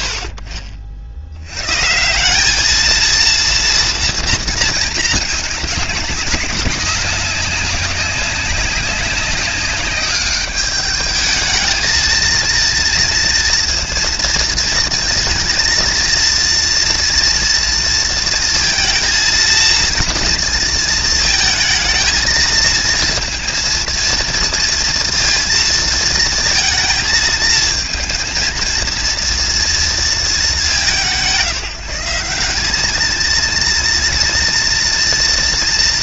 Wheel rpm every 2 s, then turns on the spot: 50, 220, 220, 200, 190, 210, 230, 230, 230, 230, 230, 230, 230, 230, 230, 210, 210, 230.
none